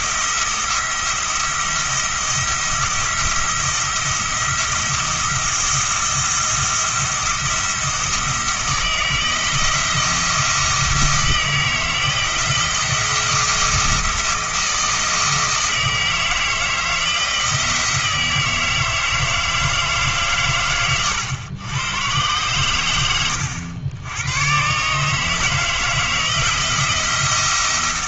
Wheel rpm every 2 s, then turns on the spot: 170, 170, 170, 170, 170, 170, 170, 160, 170, 160, 120, 110, 140, 170.
none